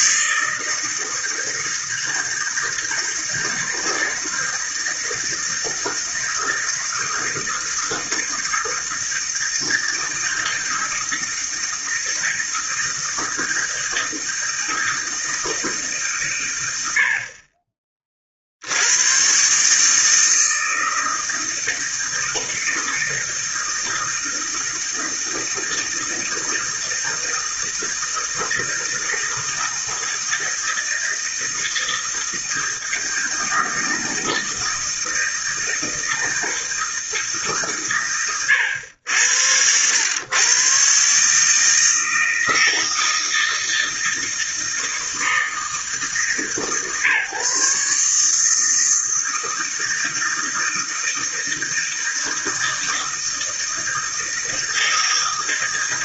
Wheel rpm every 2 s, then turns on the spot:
160, 160, 160, 160, 160, 160, 160, 160, 80, 90, 160, 160, 160, 160, 160, 160, 160, 160, 160, 90, 130, 160, 160, 140, 160, 160, 160, 160.
none